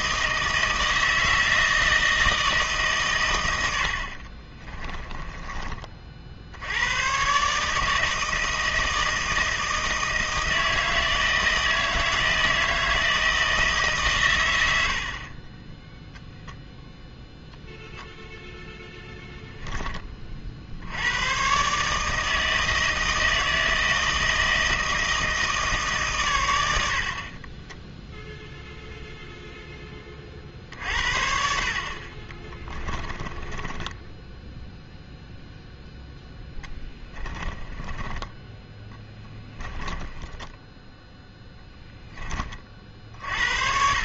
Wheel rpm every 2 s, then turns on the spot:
160, 140, 20, 100, 160, 160, 160, 70, 0, 0, 70, 160, 160, 70, 0, 60, 20, 0, 10, 10, 10, 40.
4-6 32-34 36-40